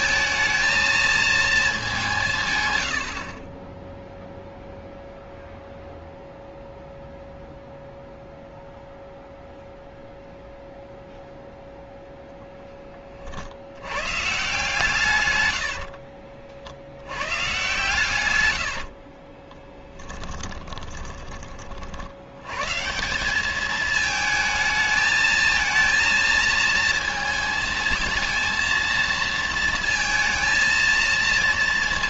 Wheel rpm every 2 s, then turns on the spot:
220, 140, 0, 0, 0, 0, 0, 140, 50, 90, 20, 110, 220, 230, 230, 230.
18-22